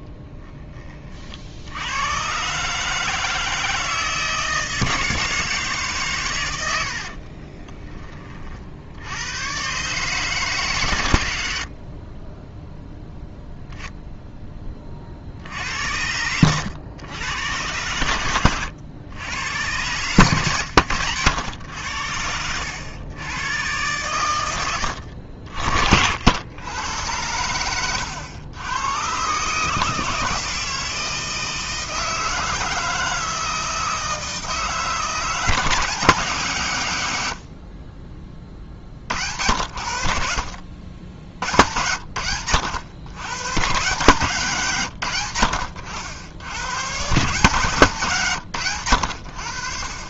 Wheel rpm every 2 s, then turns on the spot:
20, 140, 160, 90, 60, 140, 10, 20, 100, 100, 110, 100, 90, 100, 110, 160, 160, 160, 140, 30, 60, 90, 130, 110, 120.
6-8 12-14